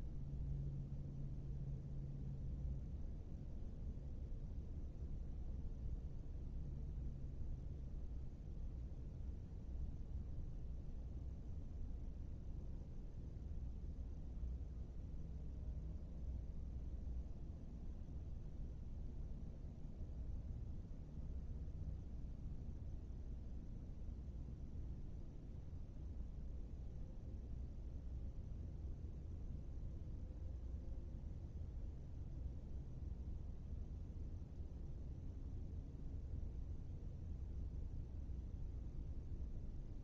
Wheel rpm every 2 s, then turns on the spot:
0, 0, 0, 0, 0, 0, 0, 0, 0, 0, 0, 0, 0, 0, 0, 0, 0, 0, 0, 0.
none